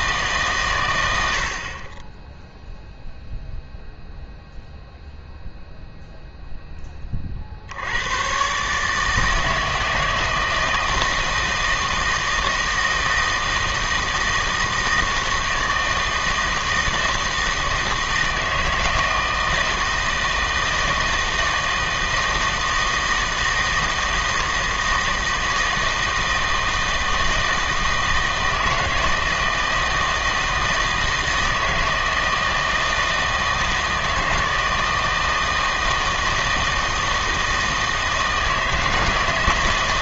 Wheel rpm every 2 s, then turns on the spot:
130, 0, 0, 10, 140, 160, 160, 160, 160, 160, 160, 160, 160, 160, 160, 160, 160, 160, 160, 160.
none